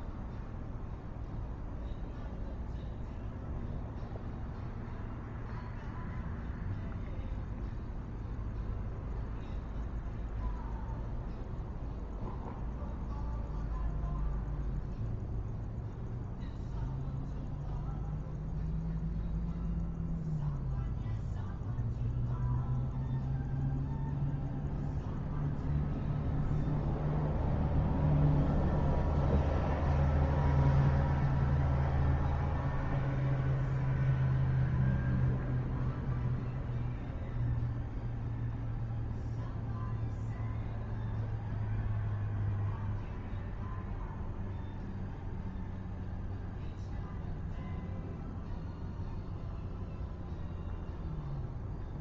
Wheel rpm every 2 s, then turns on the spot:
0, 0, 0, 0, 0, 0, 0, 0, 0, 0, 0, 0, 0, 0, 0, 0, 0, 0, 0, 0, 0, 0, 0, 0, 0, 0.
none